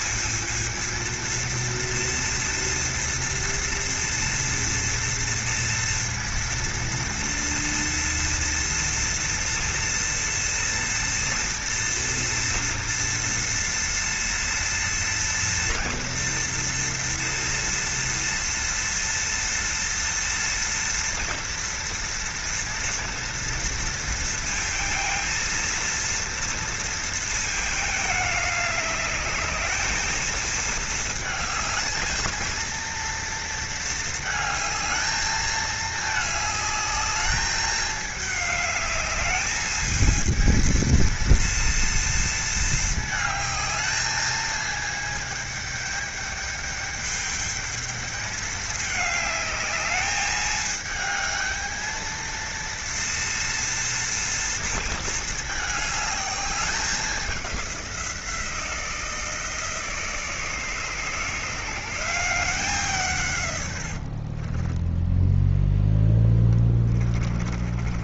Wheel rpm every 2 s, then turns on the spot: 230, 230, 230, 230, 230, 230, 230, 230, 230, 230, 230, 230, 230, 230, 210, 220, 230, 220, 210, 210, 230, 220, 220, 210, 210, 220, 230, 230, 200, 170, 160, 160, 10, 30.
64-68